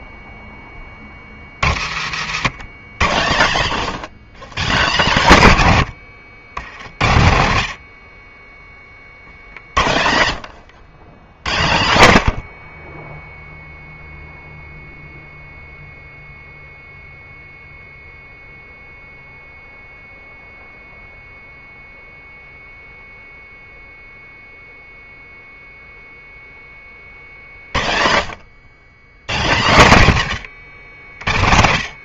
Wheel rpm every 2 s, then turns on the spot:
30, 150, 190, 80, 40, 100, 40, 0, 0, 0, 0, 0, 0, 30, 100, 90.
none